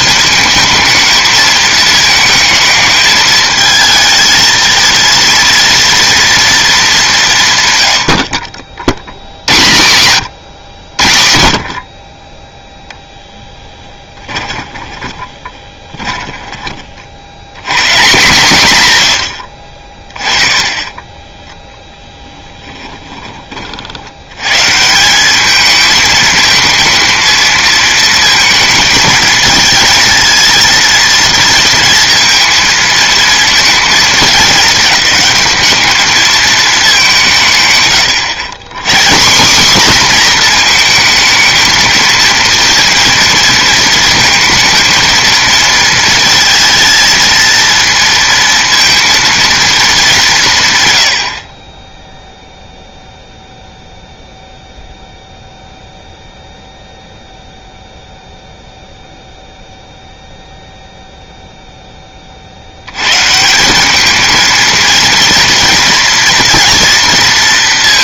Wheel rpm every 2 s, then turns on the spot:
220, 220, 230, 220, 70, 100, 0, 10, 30, 130, 20, 10, 150, 220, 230, 230, 230, 210, 210, 140, 230, 230, 230, 220, 230, 130, 0, 0, 0, 0, 0, 80, 230, 230.
14-16 22-24